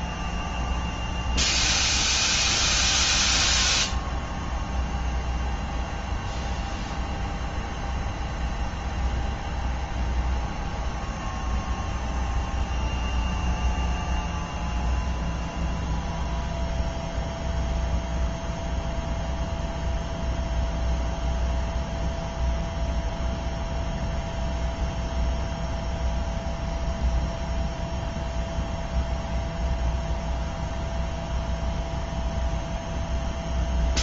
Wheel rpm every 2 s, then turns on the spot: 0, 0, 0, 0, 0, 0, 0, 0, 0, 0, 0, 0, 0, 0, 0, 0, 0.
none